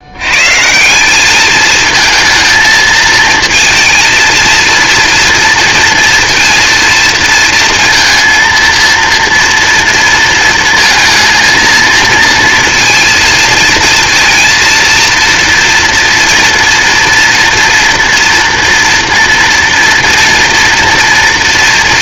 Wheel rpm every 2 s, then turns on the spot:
170, 230, 230, 230, 230, 230, 230, 230, 230, 230, 230.
none